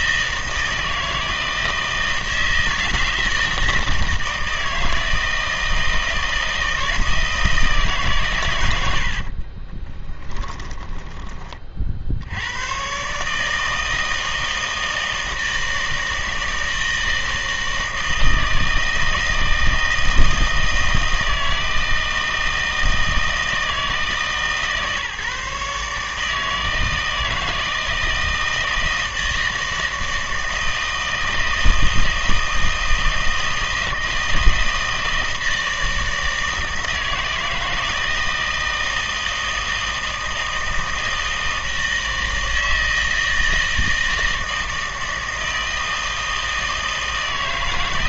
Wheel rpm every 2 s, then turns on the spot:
160, 160, 160, 160, 100, 20, 110, 160, 160, 160, 160, 160, 150, 160, 160, 160, 160, 160, 160, 160, 160, 160, 160, 160.
10-12